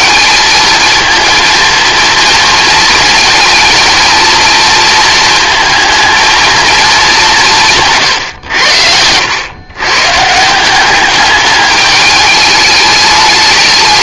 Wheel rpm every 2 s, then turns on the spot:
220, 220, 230, 220, 100, 190, 210.
none